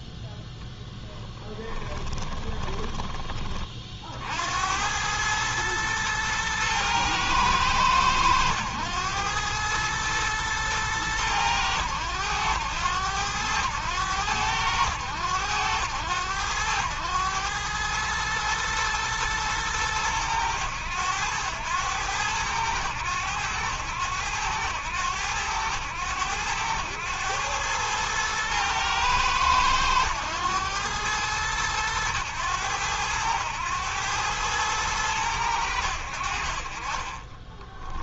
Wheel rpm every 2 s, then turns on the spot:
0, 20, 70, 110, 100, 110, 100, 100, 90, 110, 110, 100, 100, 90, 110, 100, 100, 110, 50.
2-4